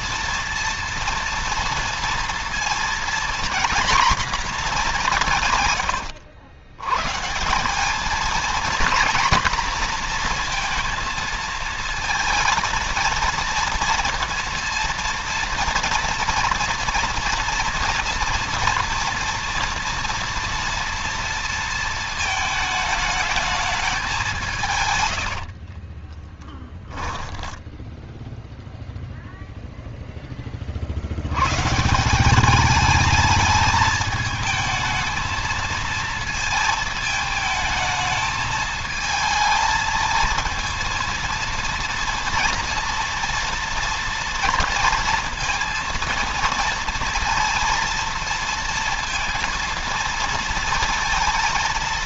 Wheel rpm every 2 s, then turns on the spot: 230, 230, 210, 110, 240, 230, 230, 230, 240, 240, 230, 220, 140, 10, 0, 50, 200, 220, 220, 220, 230, 240, 230, 230, 230, 230.
24-28